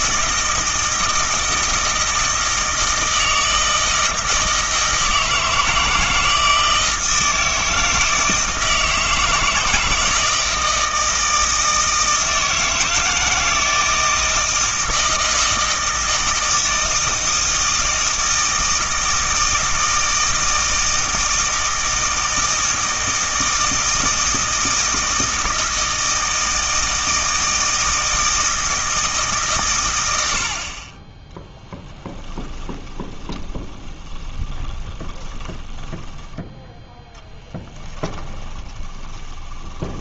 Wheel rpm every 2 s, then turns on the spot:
160, 160, 160, 160, 160, 160, 160, 160, 160, 160, 160, 160, 160, 160, 160, 30, 20, 20, 10, 20.
32-36 38-40